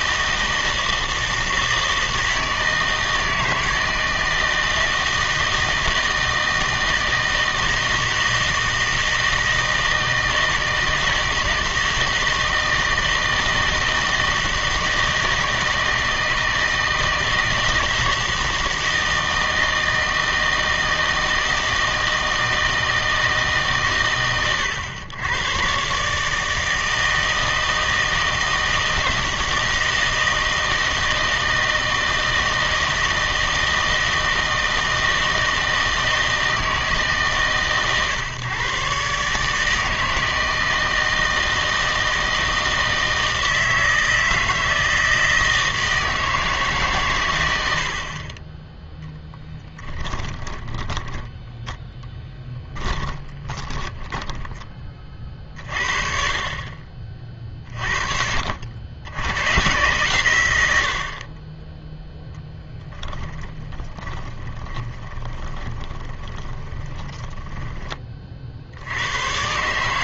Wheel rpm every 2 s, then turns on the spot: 160, 160, 160, 160, 160, 160, 160, 160, 160, 160, 160, 160, 100, 160, 160, 160, 160, 160, 160, 140, 160, 160, 160, 140, 10, 10, 10, 20, 40, 80, 80, 10, 20, 20, 70.
50-54 62-68